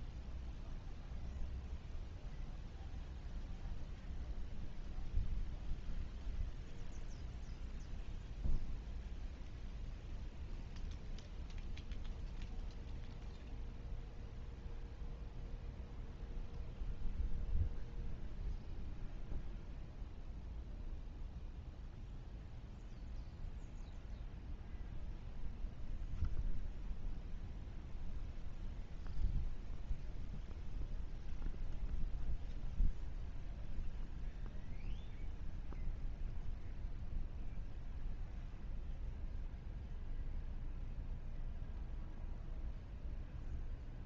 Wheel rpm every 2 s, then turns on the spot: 0, 0, 0, 0, 0, 0, 0, 0, 0, 0, 0, 0, 0, 0, 0, 0, 0, 0, 0, 0, 0, 0.
none